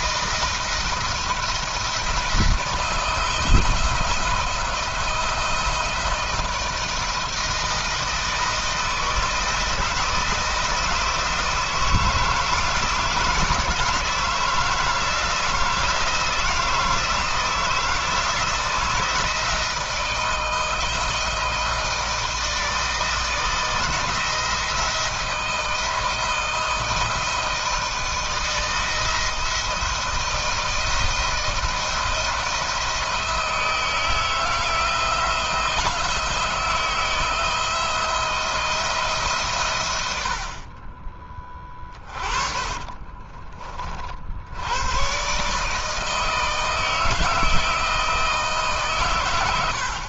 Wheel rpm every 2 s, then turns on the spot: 170, 170, 170, 160, 160, 160, 160, 160, 160, 160, 160, 160, 160, 160, 170, 170, 170, 170, 170, 160, 30, 30, 120, 160, 130.
40-44